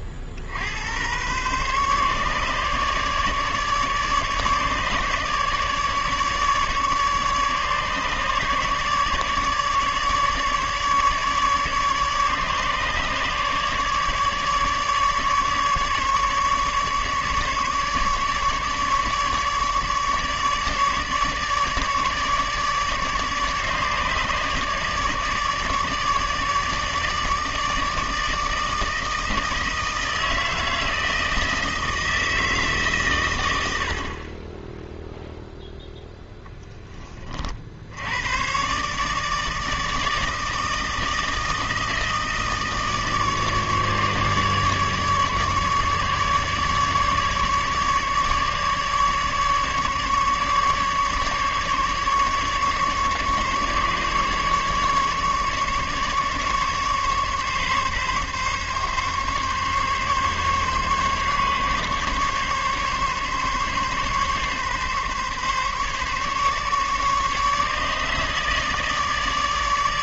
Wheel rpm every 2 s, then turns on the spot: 60, 150, 150, 150, 150, 150, 150, 150, 150, 150, 150, 150, 150, 150, 160, 160, 130, 0, 30, 150, 160, 150, 150, 150, 150, 140, 140, 150, 150, 140, 140, 140, 140, 150, 150.
none